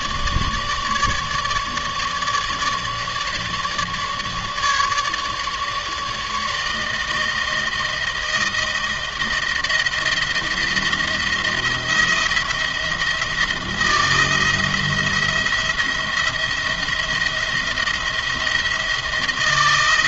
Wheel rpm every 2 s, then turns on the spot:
150, 150, 150, 160, 160, 170, 170, 160, 170, 170.
none